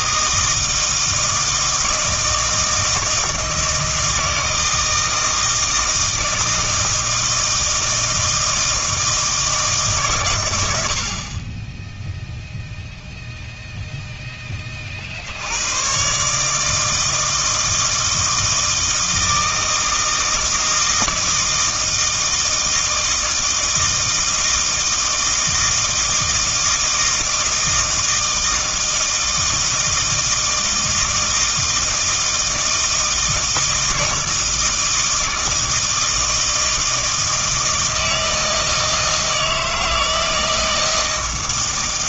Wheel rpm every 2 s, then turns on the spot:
160, 160, 160, 160, 160, 90, 0, 20, 150, 160, 160, 160, 160, 160, 160, 160, 160, 160, 160, 160, 160.
none